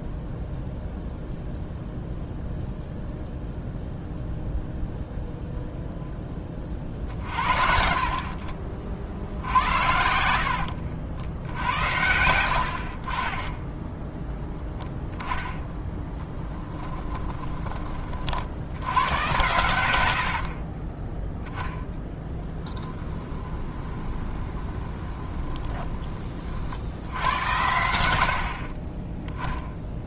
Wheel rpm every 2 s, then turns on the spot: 0, 0, 0, 40, 50, 80, 60, 0, 10, 80, 40, 20, 20, 70, 30.
10-14 16-18 20-26